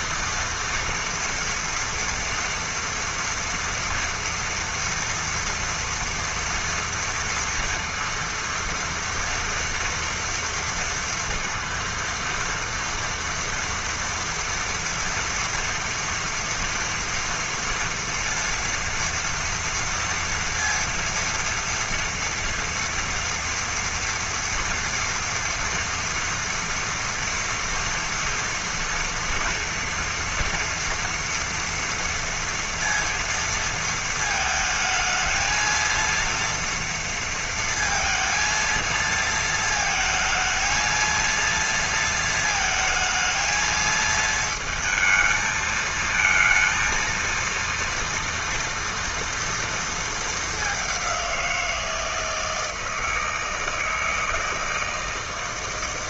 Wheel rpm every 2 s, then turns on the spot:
230, 230, 230, 240, 230, 230, 230, 230, 230, 230, 230, 230, 240, 230, 230, 230, 230, 220, 230, 230, 220, 220, 220, 230, 240, 210, 160, 160.
none